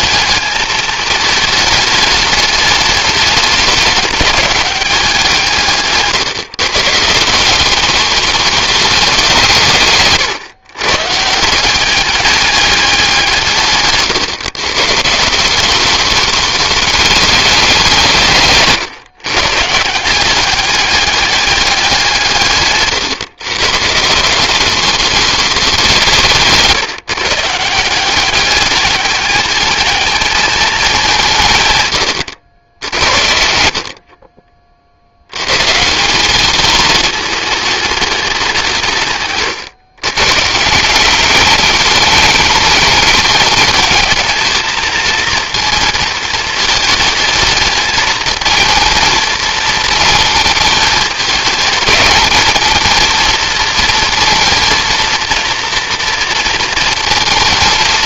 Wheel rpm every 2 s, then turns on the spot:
220, 210, 200, 140, 210, 130, 200, 130, 210, 150, 200, 150, 190, 160, 200, 210, 80, 40, 210, 180, 140, 210, 220, 220, 220, 220, 220, 230, 230.
none